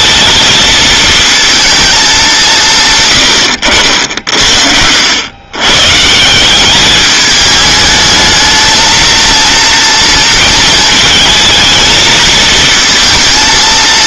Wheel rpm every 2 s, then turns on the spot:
220, 160, 70, 190, 220, 220, 220.
none